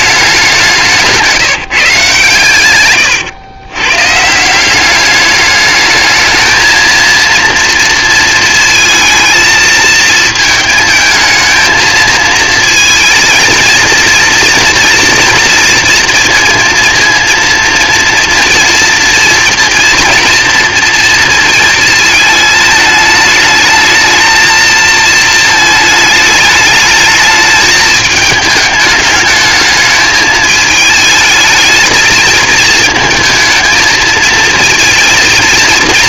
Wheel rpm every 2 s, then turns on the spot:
180, 120, 180, 230, 230, 220, 230, 230, 230, 230, 230, 220, 220, 210, 210, 220, 220, 230.
none